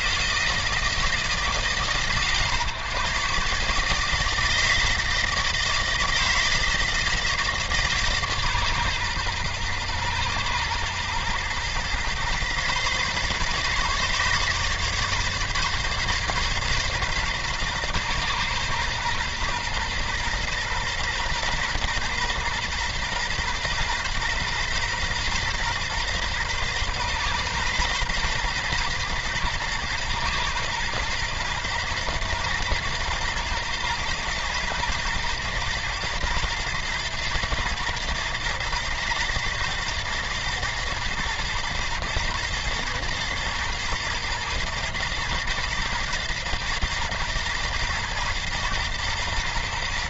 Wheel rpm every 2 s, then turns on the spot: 160, 120, 160, 160, 130, 120, 130, 140, 140, 120, 120, 130, 130, 120, 120, 120, 110, 120, 120, 120, 110, 110, 110, 110, 110.
none